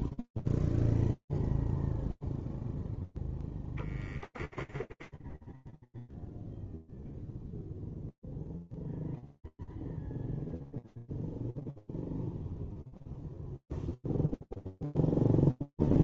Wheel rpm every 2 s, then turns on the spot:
0, 20, 0, 0, 0, 0, 0, 0.
none